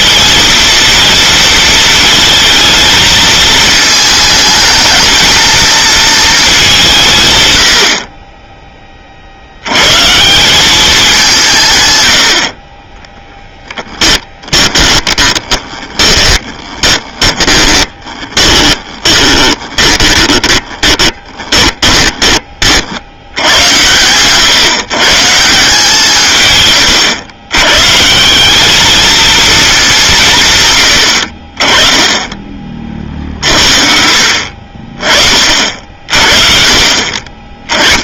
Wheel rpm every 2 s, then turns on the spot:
230, 220, 220, 200, 20, 200, 40, 20, 20, 30, 30, 40, 130, 140, 200, 130, 30, 40, 40.
14-22